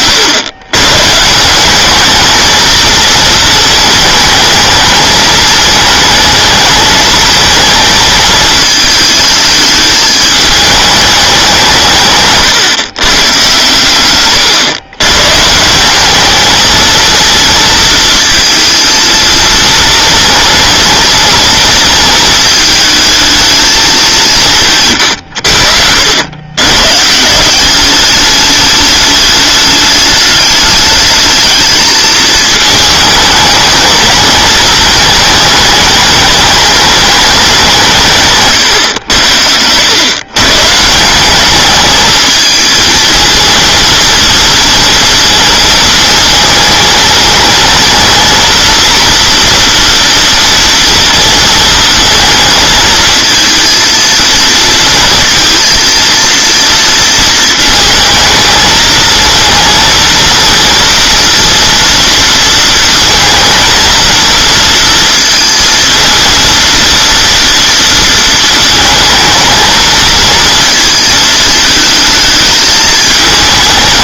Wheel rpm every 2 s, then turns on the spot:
130, 220, 220, 220, 220, 210, 140, 120, 220, 230, 240, 220, 160, 110, 210, 210, 220, 220, 210, 120, 150, 220, 230, 220, 230, 230, 220, 230, 230, 220, 230, 230, 230, 230, 220, 220, 220.
none